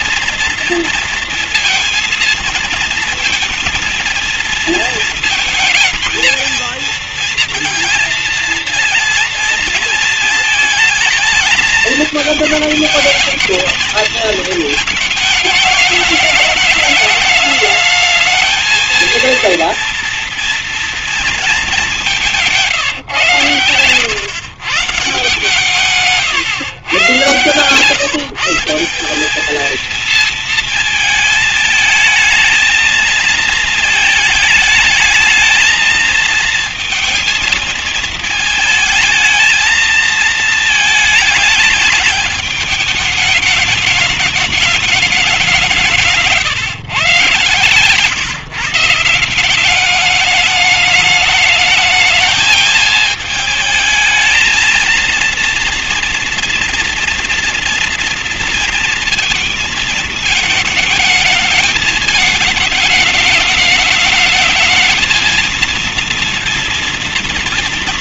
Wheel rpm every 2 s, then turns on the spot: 230, 230, 220, 230, 230, 220, 220, 220, 210, 220, 230, 150, 150, 120, 180, 220, 220, 210, 220, 220, 220, 210, 210, 140, 160, 210, 220, 220, 230, 230, 220, 210, 220, 230.
none